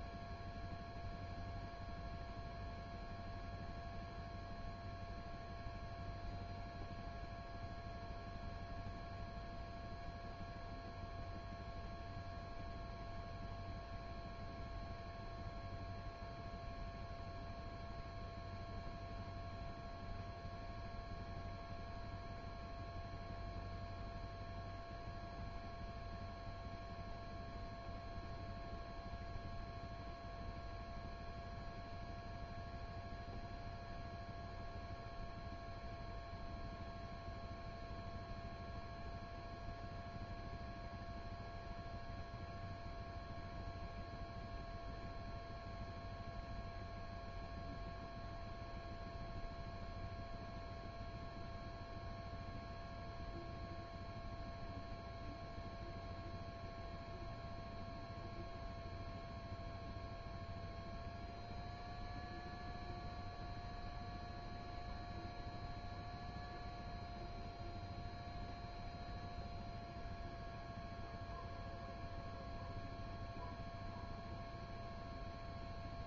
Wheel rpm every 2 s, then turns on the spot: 0, 0, 0, 0, 0, 0, 0, 0, 0, 0, 0, 0, 0, 0, 0, 0, 0, 0, 0, 0, 0, 0, 0, 0, 0, 0, 0, 0, 0, 0, 0, 0, 0, 0, 0, 0, 0, 0.
none